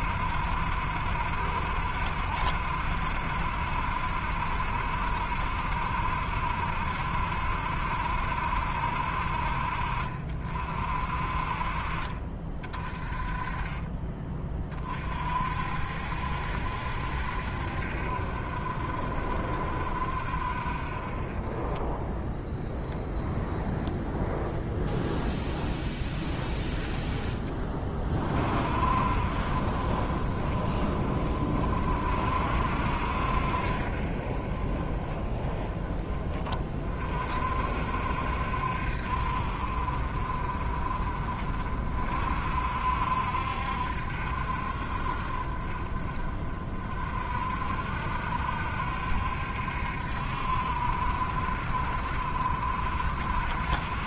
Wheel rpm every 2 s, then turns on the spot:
60, 70, 70, 70, 60, 50, 30, 40, 70, 50, 40, 20, 0, 10, 40, 30, 60, 30, 40, 60, 40, 60, 50, 40, 70, 60, 60.
22-24